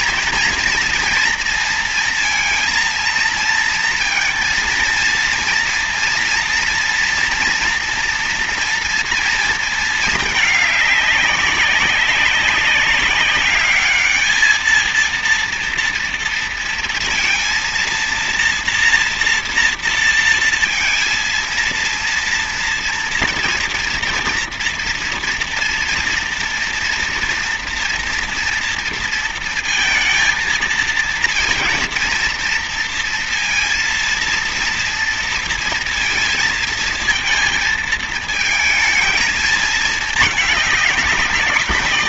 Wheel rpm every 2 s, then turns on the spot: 230, 230, 230, 230, 230, 210, 200, 220, 230, 230, 230, 230, 230, 240, 230, 230, 230, 230, 230, 230, 210.
none